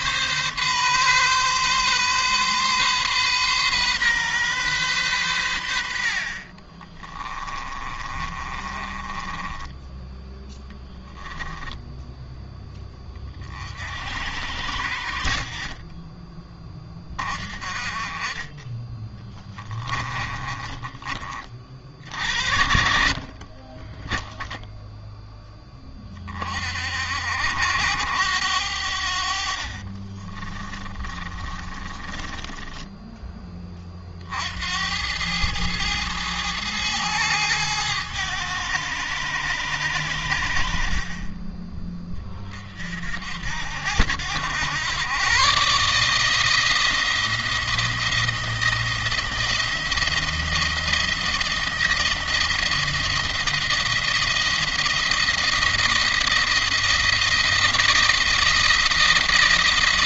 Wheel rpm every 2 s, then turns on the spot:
130, 130, 120, 30, 30, 10, 20, 50, 20, 20, 20, 70, 0, 60, 80, 30, 20, 80, 110, 100, 40, 50, 100, 170, 170, 170, 170, 170, 170, 170.
6-12 22-24 30-34